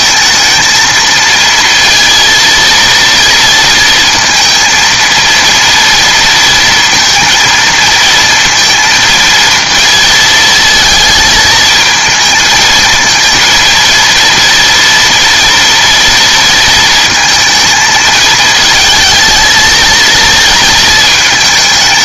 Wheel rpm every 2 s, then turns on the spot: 230, 230, 230, 230, 230, 230, 220, 230, 230, 220, 220.
none